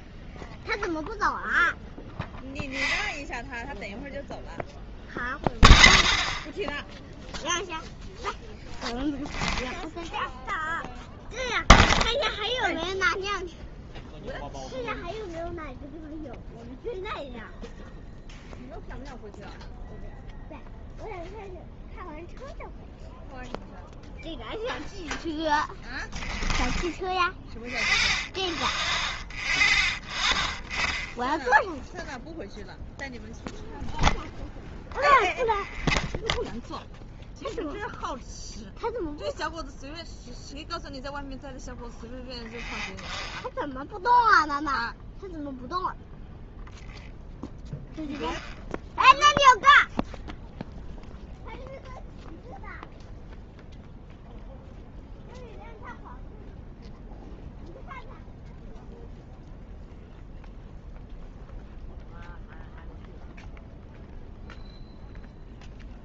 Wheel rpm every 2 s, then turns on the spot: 0, 0, 0, 0, 0, 0, 0, 0, 0, 0, 0, 0, 0, 0, 0, 0, 0, 0, 0, 0, 0, 0, 0, 0, 0, 0, 0, 0, 0, 0, 0, 0, 0.
none